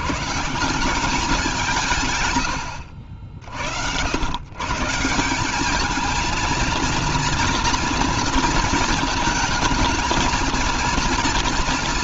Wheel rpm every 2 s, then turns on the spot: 190, 60, 150, 230, 220, 230.
none